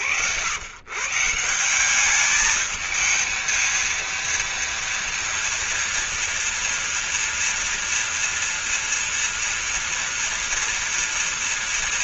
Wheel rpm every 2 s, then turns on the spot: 110, 220, 230, 230, 230, 230.
none